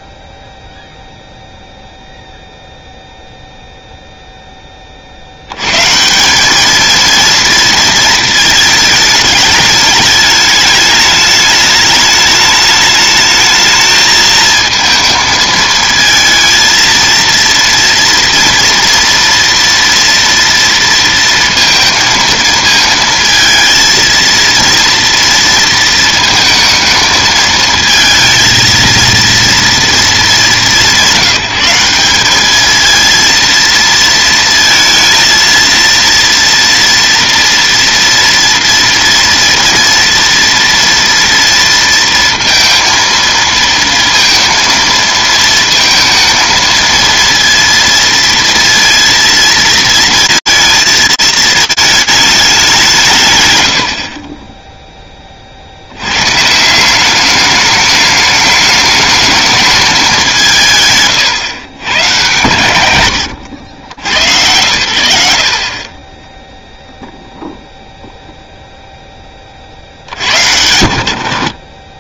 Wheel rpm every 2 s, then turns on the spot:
0, 0, 20, 220, 220, 210, 210, 220, 230, 230, 230, 230, 230, 220, 230, 200, 220, 230, 230, 230, 240, 230, 230, 230, 230, 220, 190, 10, 170, 210, 150, 130, 90, 0, 0, 80.
none